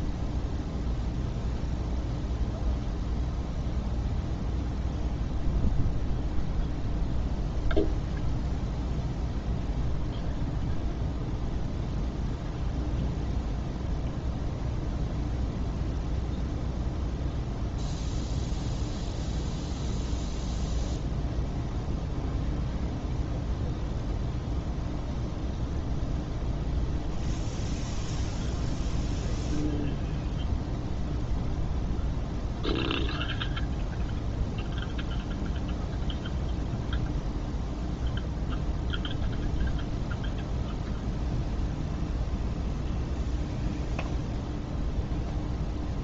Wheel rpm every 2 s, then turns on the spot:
0, 0, 0, 0, 0, 0, 0, 0, 0, 0, 0, 0, 0, 0, 0, 0, 0, 0, 0, 0, 0, 0, 0.
none